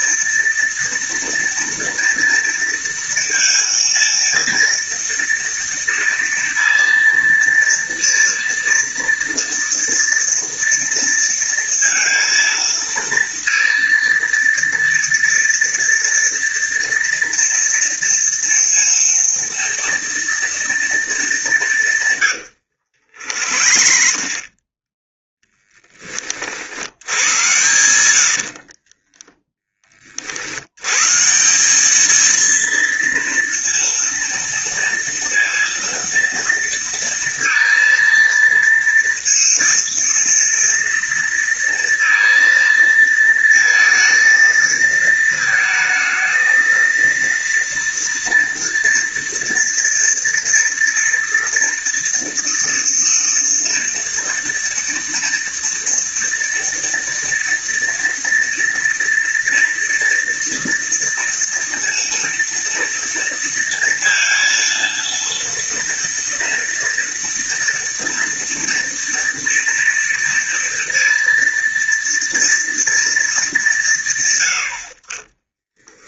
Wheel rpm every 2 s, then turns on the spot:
230, 230, 230, 230, 230, 230, 230, 230, 230, 230, 220, 80, 30, 80, 50, 100, 230, 230, 230, 230, 230, 230, 220, 230, 240, 230, 230, 230, 230, 230, 230, 230, 230, 240, 230, 230, 230, 60.
22-26 28-30